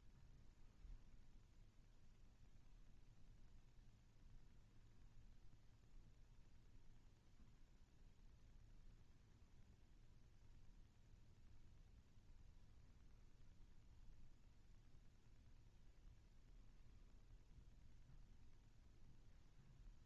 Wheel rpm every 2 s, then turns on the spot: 0, 0, 0, 0, 0, 0, 0, 0, 0, 0.
none